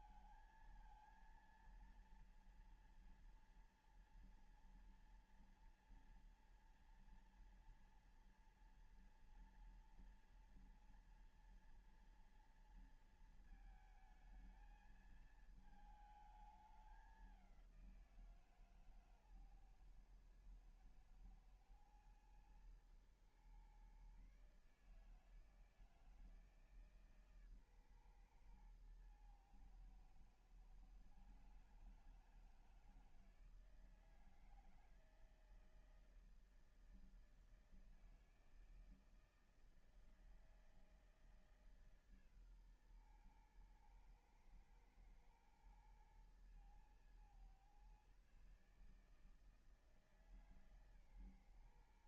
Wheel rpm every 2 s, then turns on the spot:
230, 230, 230, 230, 230, 230, 230, 220, 210, 160, 120, 110, 140, 160, 120, 120, 160, 160, 160, 160, 160, 140, 110, 110, 140, 150.
none